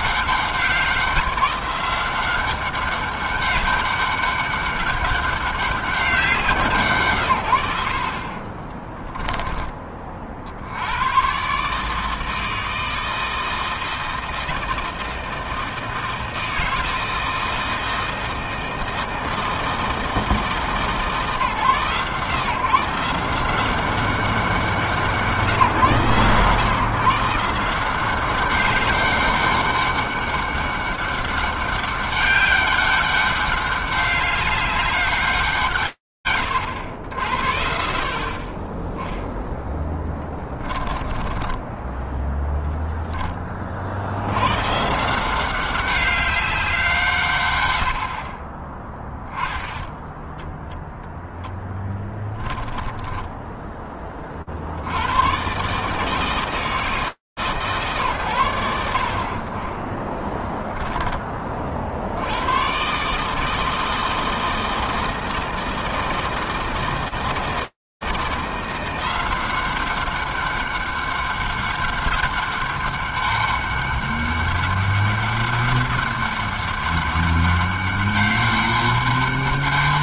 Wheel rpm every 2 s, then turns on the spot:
190, 190, 200, 180, 50, 60, 160, 160, 160, 160, 160, 140, 180, 120, 190, 200, 200, 200, 100, 20, 20, 0, 100, 190, 40, 0, 10, 70, 150, 60, 10, 100, 160, 160, 180, 200, 200, 200, 200, 200.
8-10 40-42 52-54 60-62